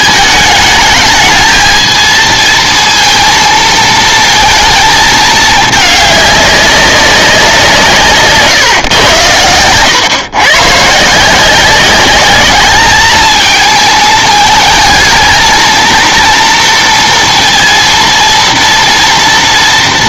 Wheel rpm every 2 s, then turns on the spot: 210, 220, 220, 200, 140, 140, 210, 220, 230, 230.
none